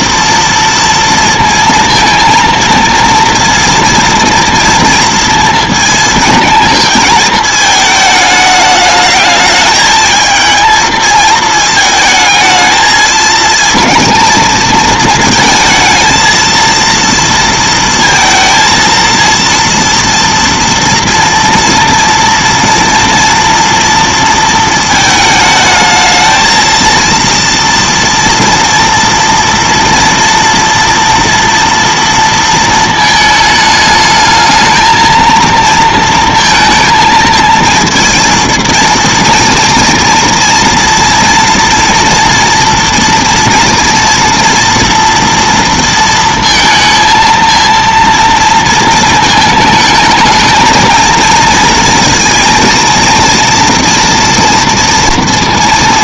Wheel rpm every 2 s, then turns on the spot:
230, 230, 230, 220, 210, 220, 220, 230, 230, 230, 230, 230, 230, 220, 230, 230, 230, 220, 230, 230, 230, 230, 230, 230, 230, 220, 230, 230.
none